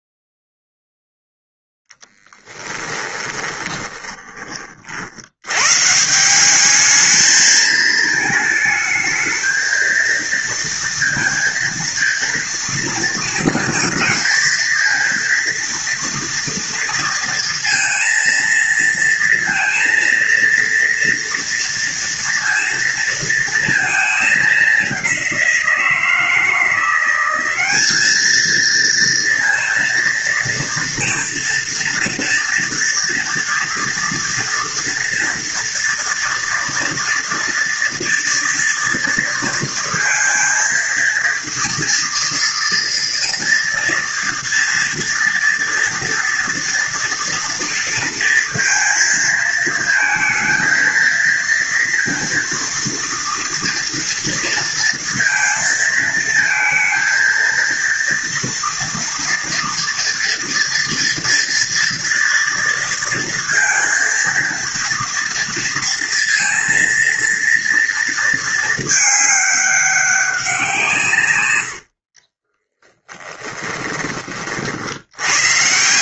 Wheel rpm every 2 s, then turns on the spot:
0, 10, 30, 190, 220, 230, 230, 230, 230, 230, 230, 230, 210, 170, 220, 230, 240, 230, 230, 230, 230, 230, 230, 230, 230, 230, 230, 230, 230, 230, 230, 230, 230, 230, 220, 180, 30, 50.
2-4 72-74